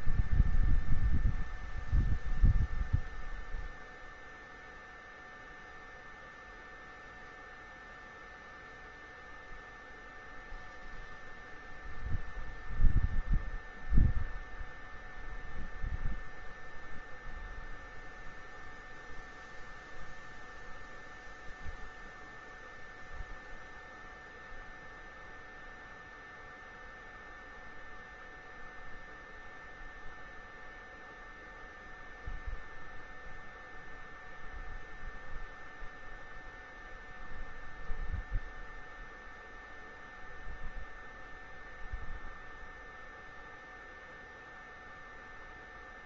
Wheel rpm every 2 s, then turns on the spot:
0, 0, 0, 0, 0, 0, 0, 0, 0, 0, 0, 0, 0, 0, 0, 0, 0, 0, 0, 0, 0, 0, 0.
none